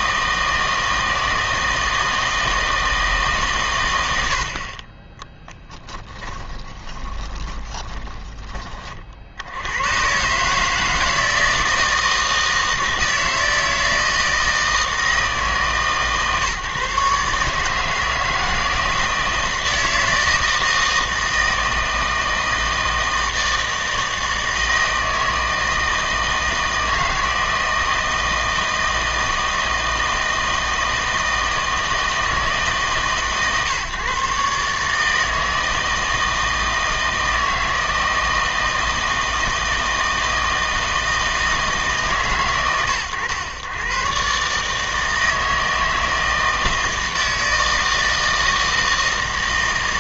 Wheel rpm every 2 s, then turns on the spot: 160, 160, 50, 20, 30, 160, 160, 160, 140, 160, 160, 160, 160, 160, 160, 160, 150, 150, 160, 160, 160, 120, 150, 160, 160.
6-8